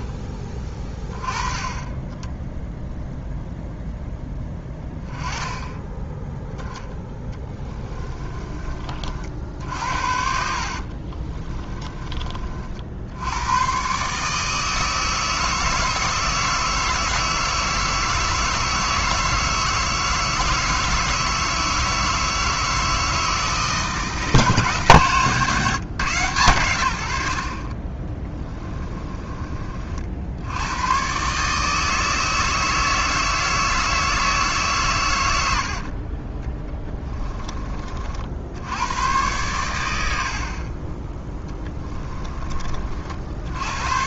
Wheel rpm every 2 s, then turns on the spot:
20, 0, 10, 10, 40, 50, 60, 160, 160, 160, 160, 160, 150, 90, 20, 100, 160, 130, 10, 100, 20, 40.
6-8 10-12 28-30 36-38 40-42